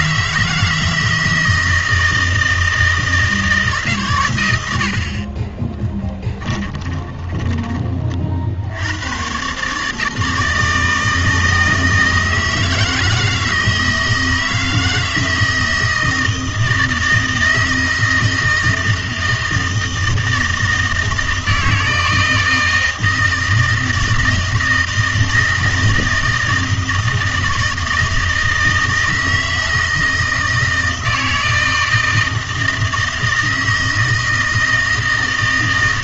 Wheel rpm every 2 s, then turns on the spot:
160, 160, 100, 20, 70, 160, 160, 160, 160, 160, 160, 160, 160, 160, 160, 160, 160, 160.
6-8